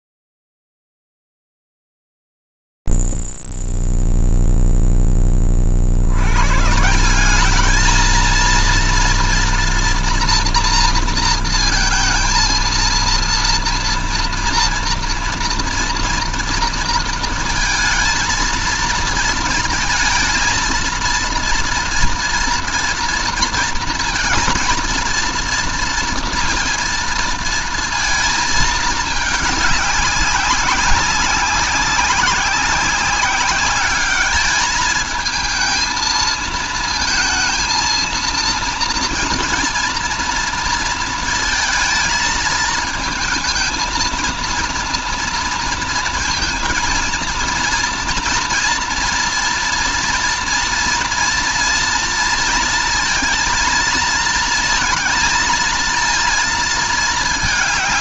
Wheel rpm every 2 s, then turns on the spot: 0, 0, 0, 110, 230, 230, 230, 230, 230, 230, 230, 230, 230, 230, 220, 200, 190, 210, 220, 230, 230, 220, 230, 230, 240, 230, 230, 230, 230.
none